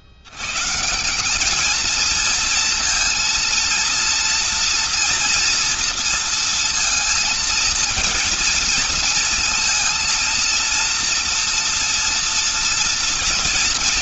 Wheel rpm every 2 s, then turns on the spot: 110, 220, 230, 230, 230, 230, 240.
none